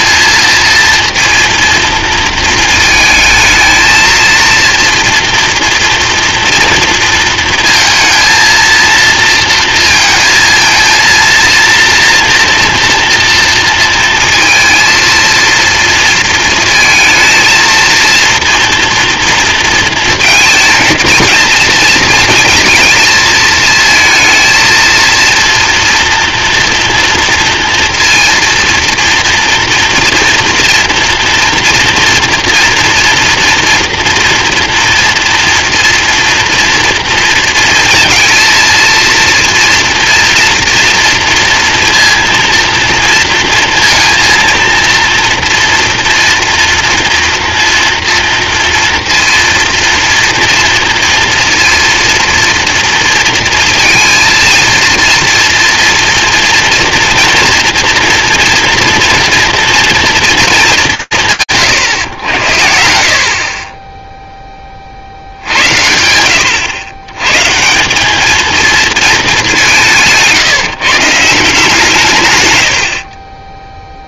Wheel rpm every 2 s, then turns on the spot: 230, 230, 240, 230, 230, 230, 230, 230, 230, 230, 220, 220, 230, 230, 230, 230, 230, 230, 230, 230, 240, 230, 230, 230, 240, 230, 230, 230, 230, 230, 120, 60, 50, 90, 220, 160, 50.
72-74